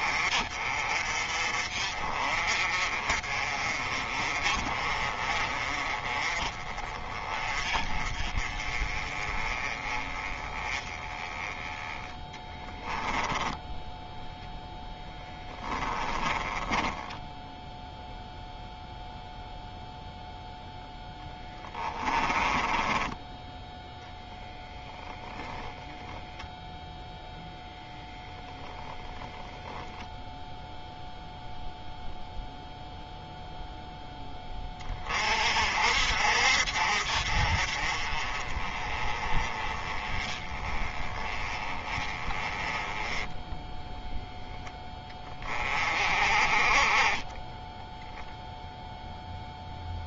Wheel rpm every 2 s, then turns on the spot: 40, 40, 30, 20, 20, 20, 10, 10, 20, 0, 10, 10, 0, 0, 0, 0, 0, 30, 50, 30, 20, 10, 10, 30, 0.
12-18 22-24